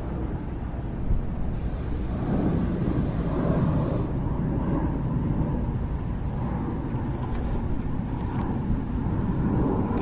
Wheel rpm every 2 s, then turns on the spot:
0, 0, 0, 0, 0.
none